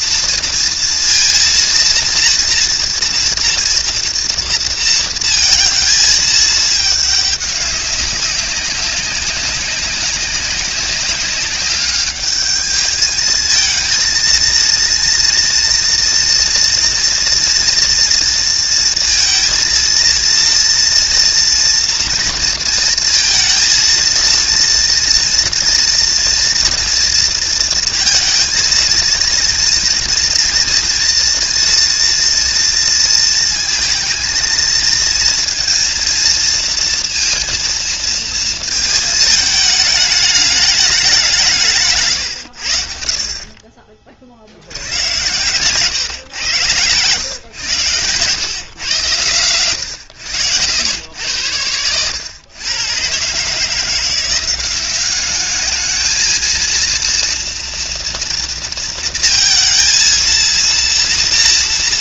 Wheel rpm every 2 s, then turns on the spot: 230, 230, 230, 220, 200, 190, 210, 230, 240, 230, 230, 230, 230, 230, 230, 230, 230, 230, 230, 230, 210, 80, 80, 110, 120, 80, 120, 190, 230, 230, 230.
none